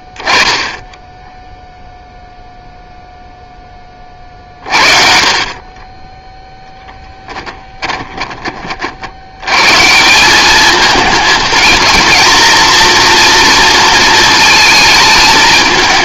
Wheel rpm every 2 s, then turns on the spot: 0, 0, 40, 10, 30, 200, 230, 220.
none